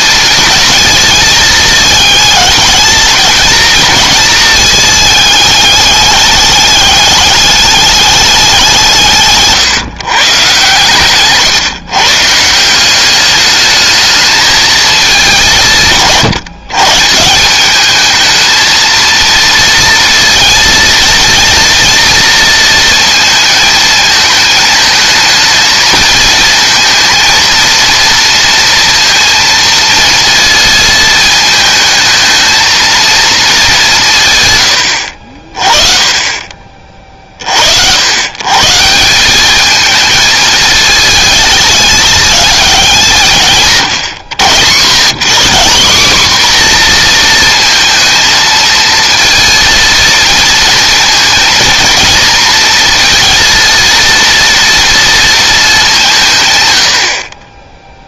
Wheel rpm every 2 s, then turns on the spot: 220, 220, 220, 210, 170, 130, 180, 220, 140, 230, 230, 230, 220, 230, 230, 230, 230, 110, 30, 150, 220, 200, 110, 250, 230, 230, 230, 230, 100.
none